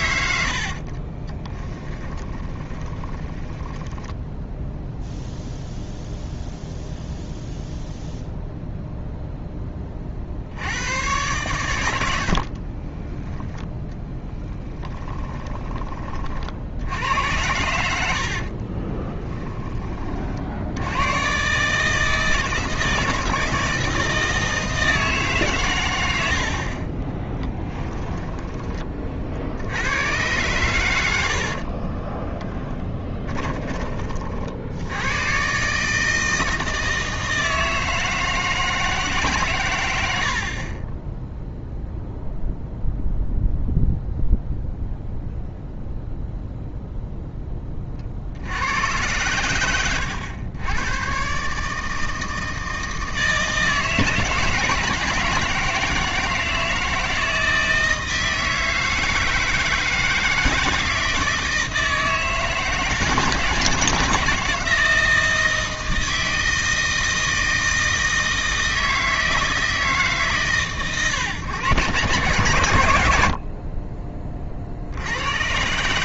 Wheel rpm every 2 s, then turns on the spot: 60, 30, 0, 0, 0, 90, 30, 20, 70, 30, 80, 160, 160, 50, 40, 110, 10, 80, 160, 160, 40, 0, 0, 0, 90, 100, 160, 160, 160, 160, 160, 160, 160, 160, 160, 130, 110, 60.
0-4 12-16 18-20 32-34